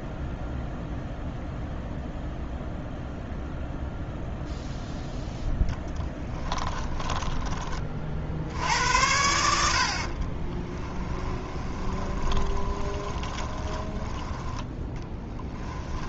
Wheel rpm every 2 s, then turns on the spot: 0, 0, 0, 20, 70, 30, 20, 10.
6-8 10-14